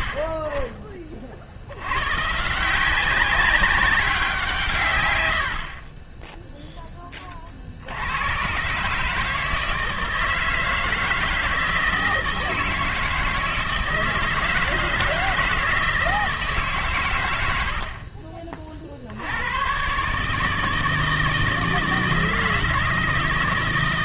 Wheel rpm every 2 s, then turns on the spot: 50, 170, 150, 0, 120, 160, 160, 160, 140, 40, 160, 160.
none